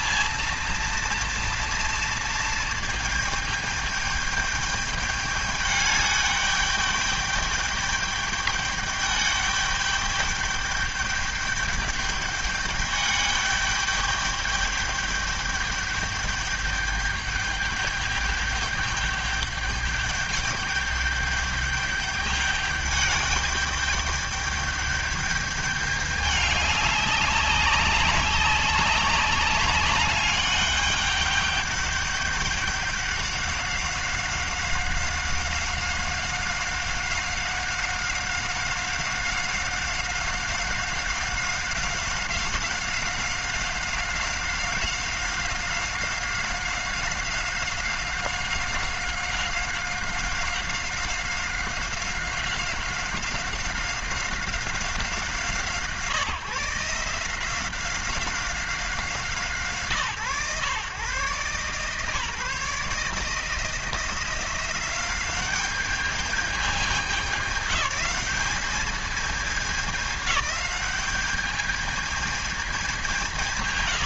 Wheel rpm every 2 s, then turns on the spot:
230, 230, 210, 210, 210, 210, 210, 210, 210, 210, 210, 210, 210, 200, 190, 200, 200, 190, 190, 190, 190, 190, 190, 190, 190, 190, 190, 180, 160, 180, 130, 150, 180, 210, 210, 200, 200.
none